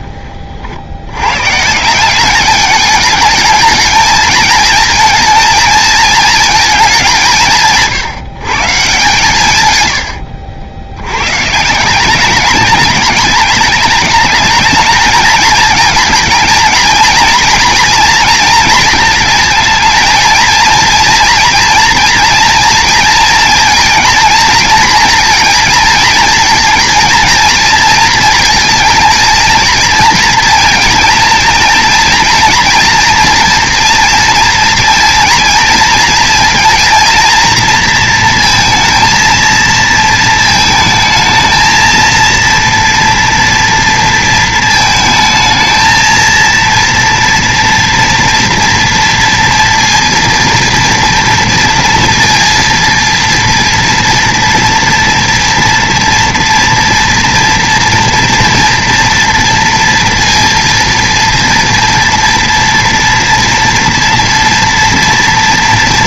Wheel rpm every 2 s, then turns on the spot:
50, 210, 220, 210, 150, 80, 210, 220, 230, 220, 230, 230, 230, 230, 230, 230, 240, 230, 230, 230, 220, 230, 220, 230, 230, 230, 230, 230, 230, 230, 230, 230, 230.
none